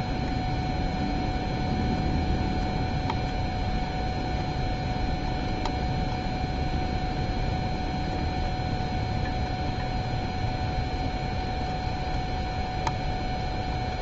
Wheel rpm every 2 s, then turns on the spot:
0, 0, 0, 0, 0, 0, 0.
none